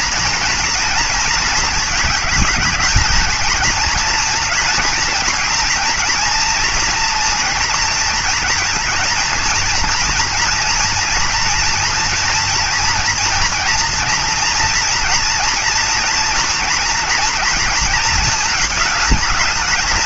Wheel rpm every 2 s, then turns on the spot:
230, 220, 220, 230, 230, 230, 230, 230, 230, 220.
none